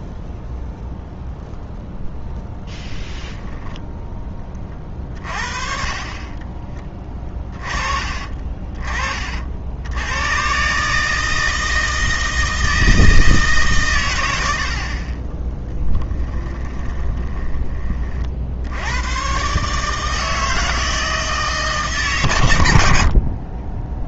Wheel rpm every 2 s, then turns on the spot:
0, 0, 30, 30, 40, 140, 160, 60, 20, 70, 160, 100.
6-8 16-18